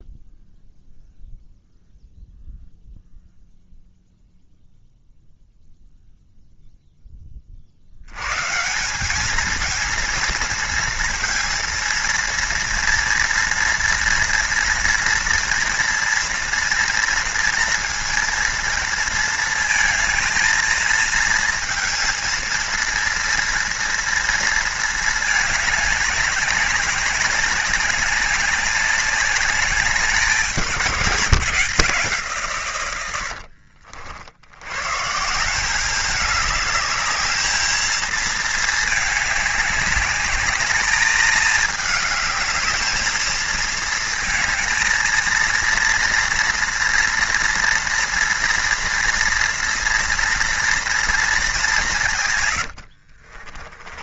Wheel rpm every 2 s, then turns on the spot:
0, 0, 0, 10, 200, 230, 230, 230, 230, 230, 230, 230, 220, 200, 200, 170, 90, 150, 210, 210, 220, 220, 230, 230, 230, 230, 60.
52-54